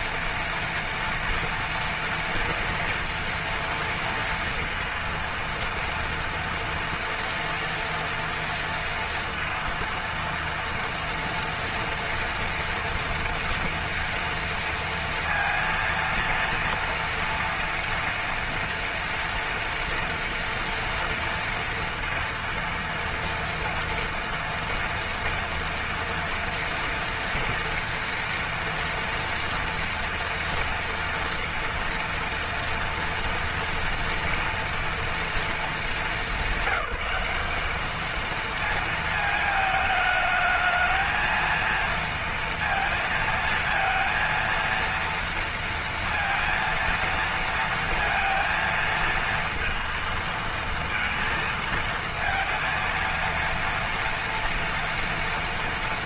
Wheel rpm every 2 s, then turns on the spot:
230, 230, 230, 230, 230, 230, 230, 230, 230, 230, 230, 230, 230, 230, 230, 230, 230, 230, 210, 220, 220, 230, 230, 230, 230, 230, 230, 230.
none